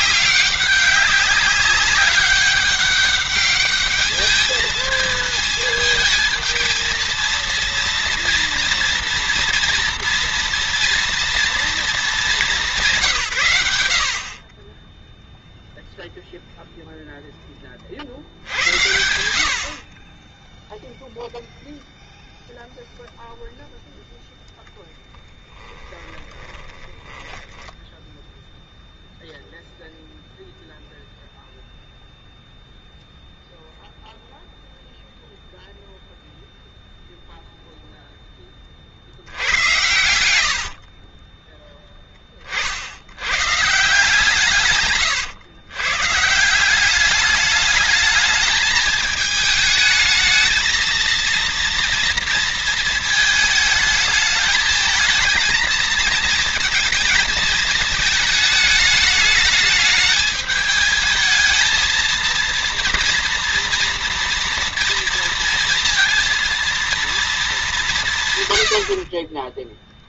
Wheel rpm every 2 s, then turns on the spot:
200, 200, 220, 230, 230, 230, 190, 30, 0, 80, 0, 0, 10, 20, 0, 0, 0, 0, 0, 40, 60, 60, 120, 190, 220, 230, 230, 220, 220, 210, 220, 230, 230, 230, 80.
24-28 40-42